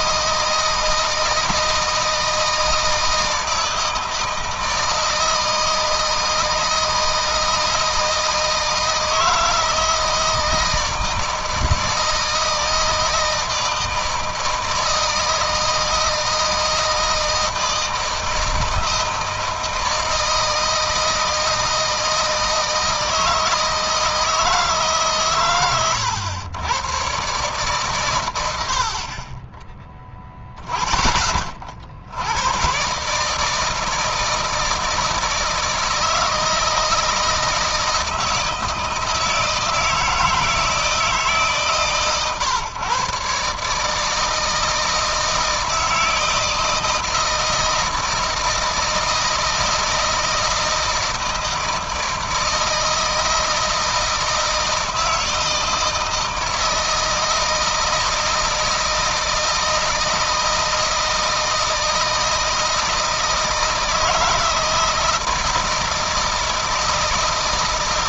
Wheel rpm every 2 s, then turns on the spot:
160, 160, 160, 160, 160, 160, 160, 160, 160, 160, 160, 160, 140, 120, 60, 20, 130, 160, 160, 160, 160, 130, 160, 160, 160, 160, 160, 160, 160, 160, 160, 160, 170, 160.
none